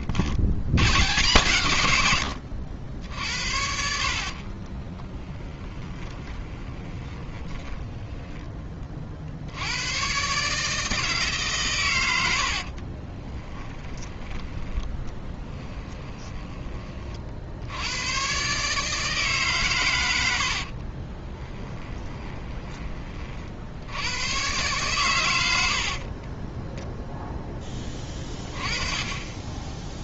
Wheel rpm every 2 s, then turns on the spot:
110, 90, 50, 20, 30, 150, 40, 10, 30, 150, 40, 30, 120, 20, 20.
4-8 12-16 20-22